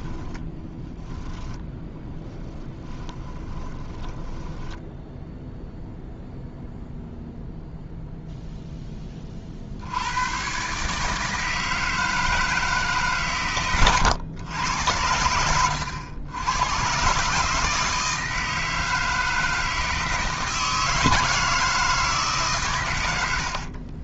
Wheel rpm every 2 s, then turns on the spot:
10, 10, 10, 0, 10, 140, 150, 90, 130, 160, 160, 110.
0-6